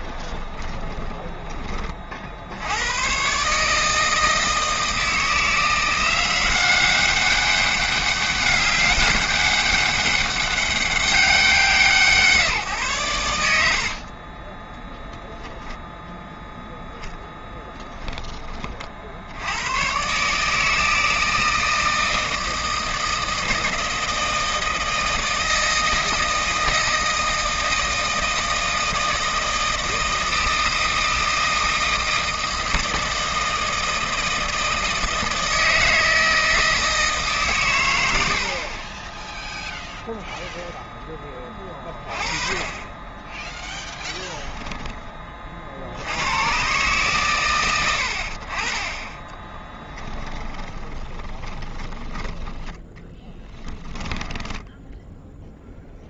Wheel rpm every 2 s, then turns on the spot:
20, 110, 160, 200, 200, 200, 120, 10, 10, 60, 160, 160, 160, 160, 160, 160, 160, 160, 150, 10, 10, 20, 20, 130, 20, 20, 10, 0.
0-2 50-54